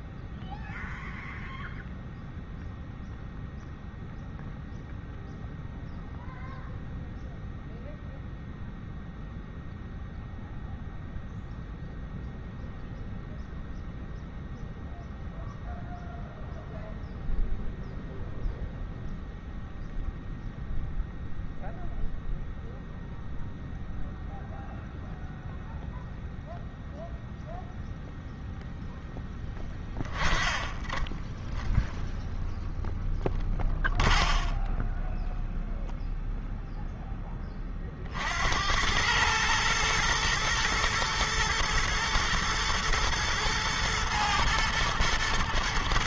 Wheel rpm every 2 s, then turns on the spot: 0, 0, 0, 0, 0, 0, 0, 0, 0, 0, 0, 0, 0, 0, 0, 10, 0, 0, 0, 70, 110, 120, 110.
none